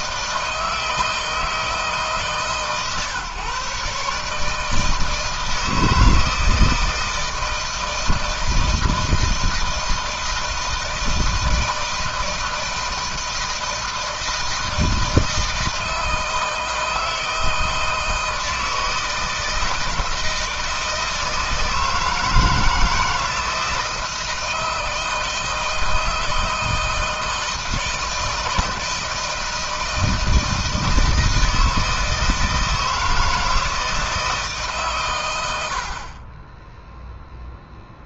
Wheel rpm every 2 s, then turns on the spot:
160, 150, 150, 160, 160, 160, 160, 160, 160, 160, 160, 160, 160, 160, 160, 160, 160, 150, 30.
none